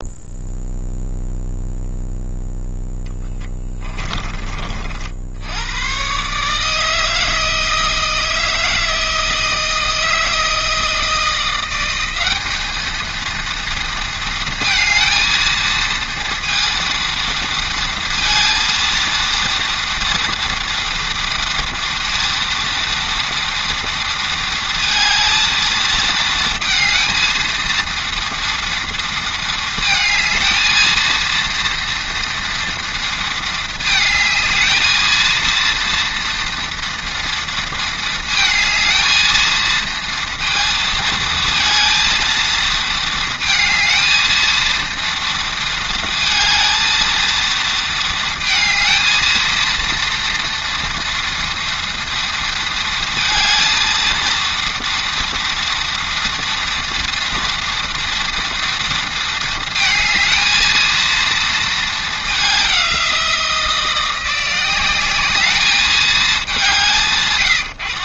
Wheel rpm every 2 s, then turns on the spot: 0, 10, 70, 160, 160, 170, 220, 230, 230, 230, 230, 230, 220, 230, 230, 230, 230, 220, 230, 220, 230, 220, 230, 220, 220, 230, 230, 230, 230, 230, 230, 180, 200, 110.
2-4